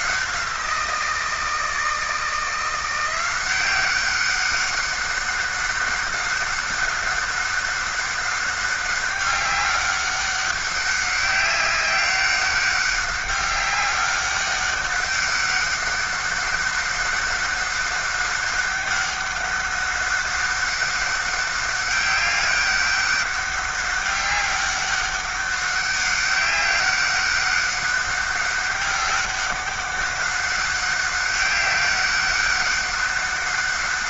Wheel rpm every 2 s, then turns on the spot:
170, 170, 200, 190, 200, 190, 200, 200, 190, 200, 190, 200, 200, 200, 200, 190, 200.
none